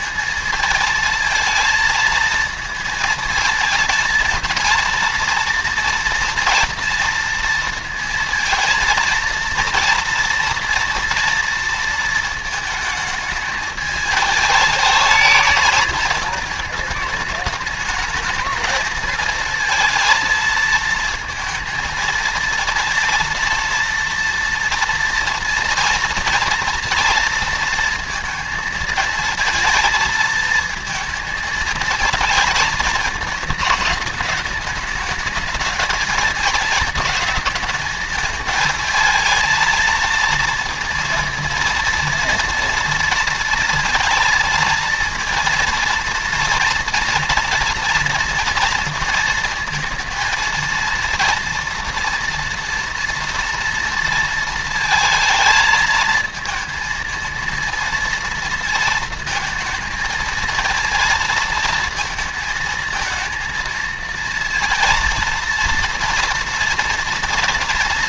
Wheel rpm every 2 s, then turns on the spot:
230, 230, 230, 230, 230, 230, 220, 210, 210, 220, 230, 230, 230, 230, 230, 220, 220, 220, 220, 220, 230, 230, 230, 230, 230, 230, 230, 220, 230, 230, 230, 230, 230, 230.
none